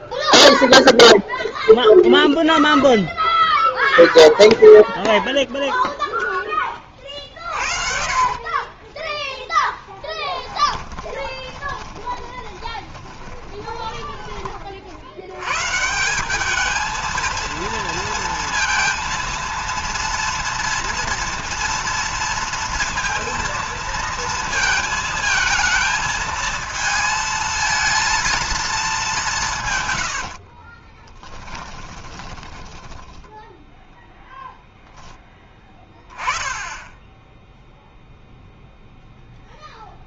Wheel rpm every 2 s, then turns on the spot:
0, 0, 0, 10, 30, 10, 20, 40, 210, 230, 230, 230, 230, 220, 220, 50, 10, 0, 20, 0.
8-14 30-34